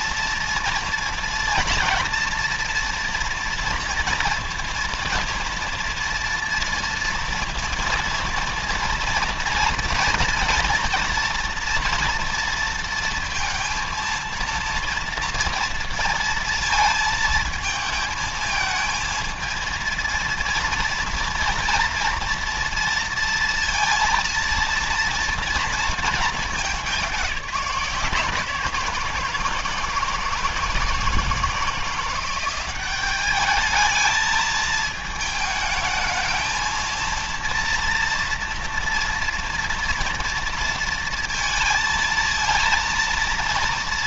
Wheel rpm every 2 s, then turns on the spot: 230, 230, 230, 230, 230, 230, 230, 230, 230, 220, 230, 230, 230, 210, 170, 160, 190, 220, 220, 230, 230, 230.
none